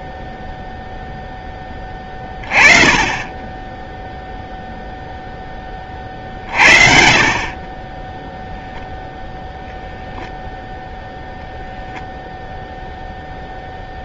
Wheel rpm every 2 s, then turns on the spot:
0, 20, 0, 50, 0, 0, 0.
none